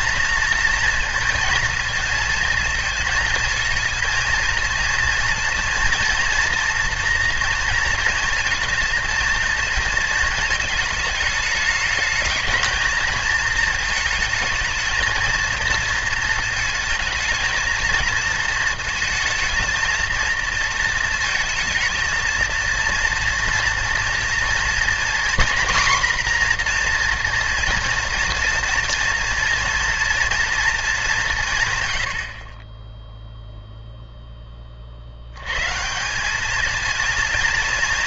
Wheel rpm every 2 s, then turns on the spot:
230, 220, 230, 230, 230, 220, 220, 220, 220, 230, 220, 230, 230, 240, 230, 220, 20, 40, 220.
none